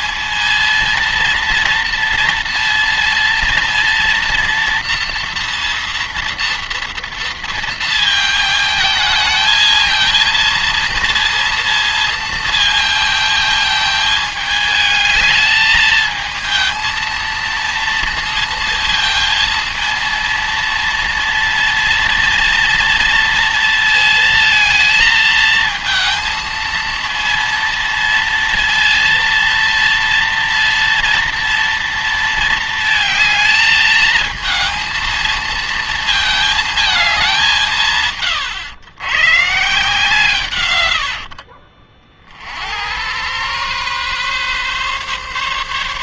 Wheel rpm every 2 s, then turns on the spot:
230, 230, 230, 230, 220, 230, 220, 220, 220, 230, 230, 230, 220, 230, 230, 230, 220, 220, 220, 120, 110, 90, 140.
none